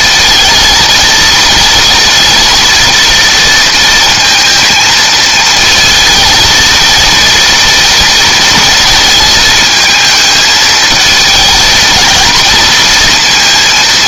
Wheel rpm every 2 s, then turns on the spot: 230, 230, 230, 220, 230, 220, 230.
none